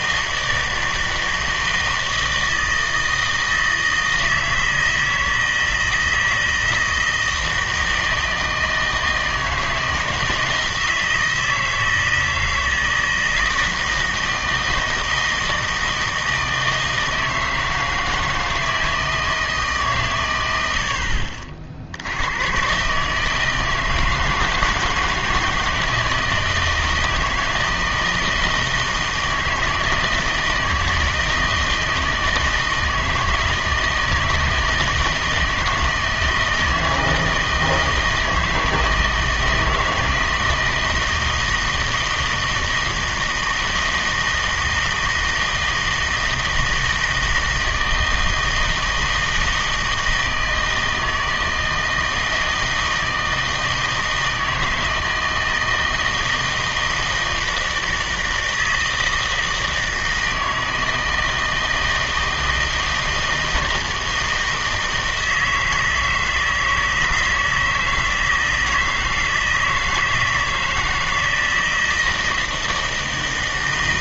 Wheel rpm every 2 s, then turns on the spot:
160, 160, 160, 160, 160, 160, 160, 160, 160, 160, 90, 120, 160, 160, 160, 160, 160, 160, 160, 160, 160, 160, 160, 160, 160, 160, 160, 160, 160, 160, 160, 160, 160, 160, 160, 160, 160.
none